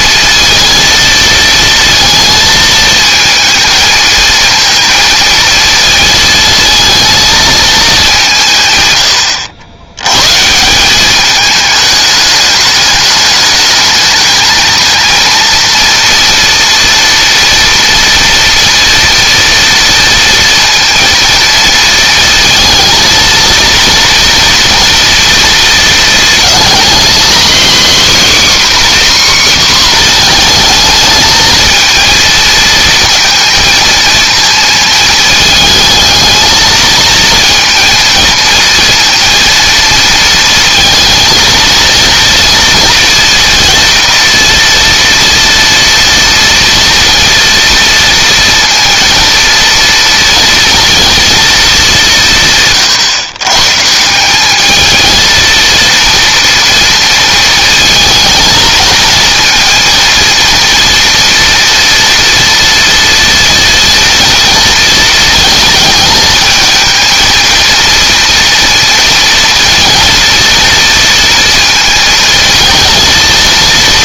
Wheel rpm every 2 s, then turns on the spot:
230, 220, 230, 220, 120, 180, 210, 220, 230, 230, 230, 220, 230, 240, 270, 220, 220, 230, 220, 230, 230, 230, 230, 230, 230, 230, 140, 210, 230, 220, 230, 230, 230, 220, 230, 230, 220.
none